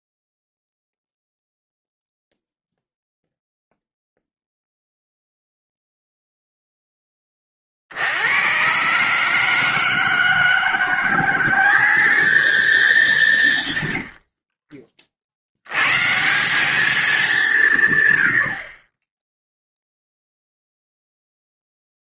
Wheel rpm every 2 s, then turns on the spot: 0, 0, 0, 0, 110, 170, 210, 50, 190, 60, 0.
14-16